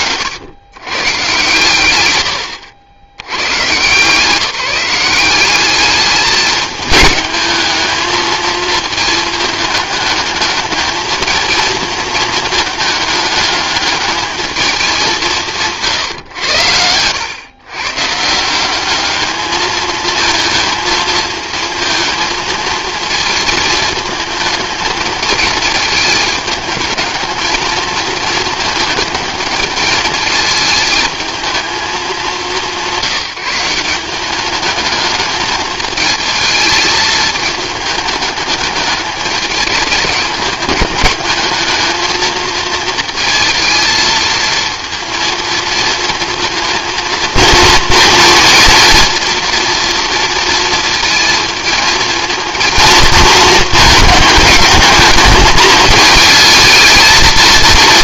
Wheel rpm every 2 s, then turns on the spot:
130, 100, 180, 210, 220, 220, 210, 200, 100, 200, 220, 220, 230, 220, 220, 220, 160, 210, 220, 210, 210, 220, 230, 230, 230, 220, 230, 210, 220.
none